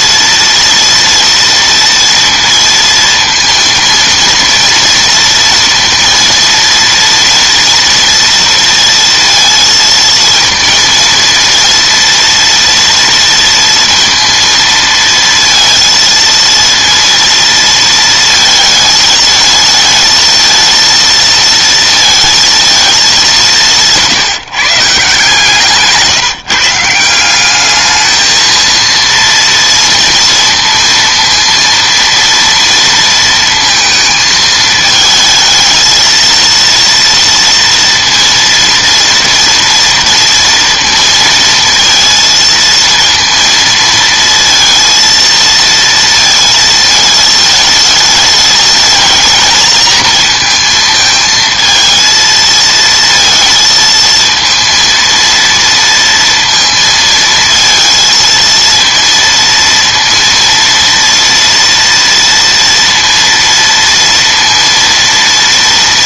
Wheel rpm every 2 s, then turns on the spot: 230, 230, 230, 230, 230, 230, 230, 230, 230, 220, 230, 230, 150, 160, 230, 230, 230, 220, 230, 230, 230, 230, 230, 220, 220, 220, 230, 230, 230, 230, 230, 230, 230.
none